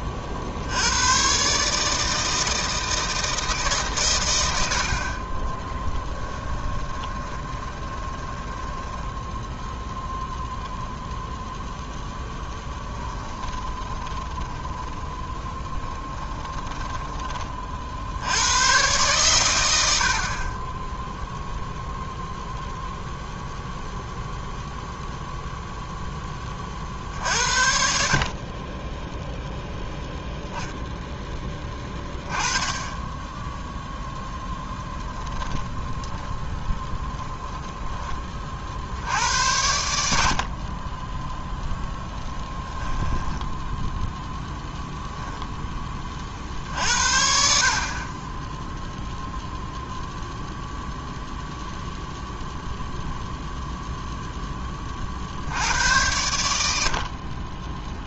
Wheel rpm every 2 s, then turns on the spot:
40, 160, 80, 10, 10, 0, 10, 20, 10, 100, 40, 0, 0, 30, 30, 0, 10, 10, 10, 40, 40, 10, 0, 50, 10, 0, 0, 10, 80.
6-10 14-18 34-38 42-44